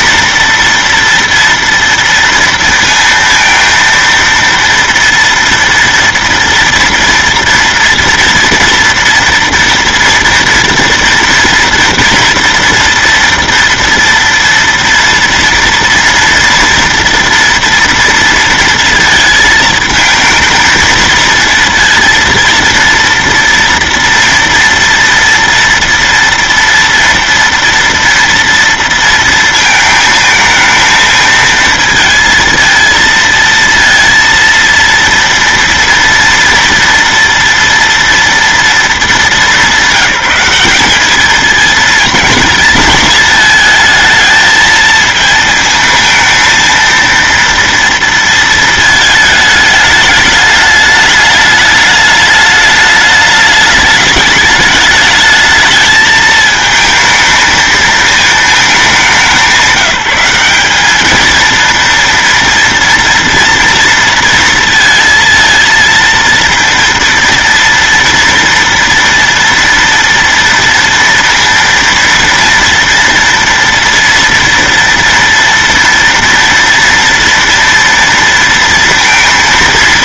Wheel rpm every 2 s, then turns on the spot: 240, 230, 230, 230, 230, 230, 230, 230, 230, 230, 220, 230, 230, 230, 230, 220, 230, 230, 230, 230, 200, 220, 220, 230, 220, 210, 210, 210, 220, 210, 200, 230, 220, 230, 230, 230, 230, 230, 230, 230.
none